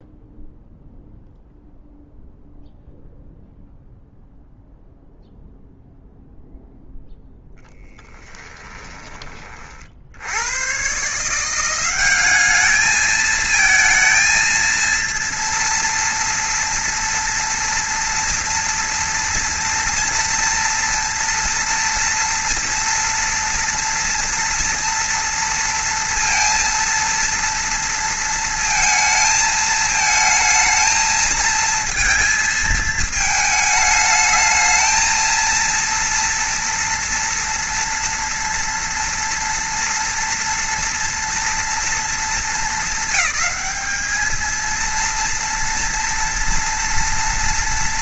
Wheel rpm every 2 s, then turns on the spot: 0, 0, 0, 0, 20, 100, 210, 220, 230, 230, 230, 230, 230, 230, 230, 220, 220, 220, 230, 230, 230, 220, 230, 240.
8-10